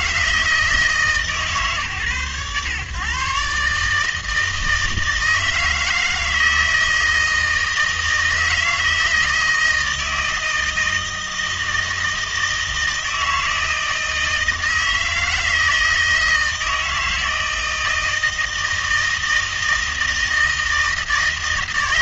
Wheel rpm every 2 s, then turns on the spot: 160, 120, 160, 160, 160, 160, 160, 160, 160, 160, 160.
none